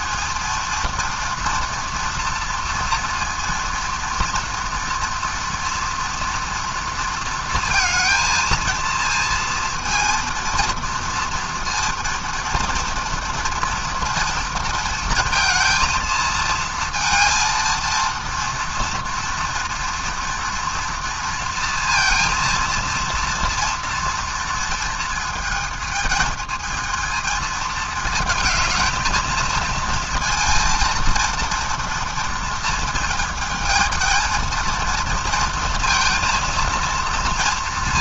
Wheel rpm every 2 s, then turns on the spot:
230, 230, 230, 230, 230, 230, 230, 230, 220, 230, 230, 230, 230, 220, 220, 230, 230, 230, 230.
none